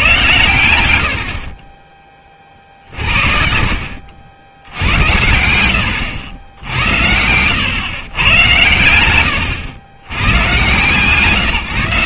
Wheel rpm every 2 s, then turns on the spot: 100, 40, 80, 80, 100, 130.
none